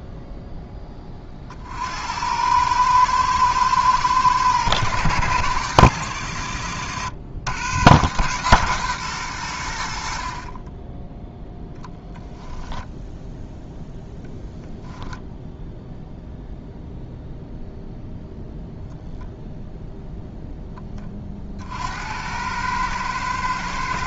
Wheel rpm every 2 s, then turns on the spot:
50, 110, 110, 110, 90, 0, 0, 0, 0, 0, 40, 110.
none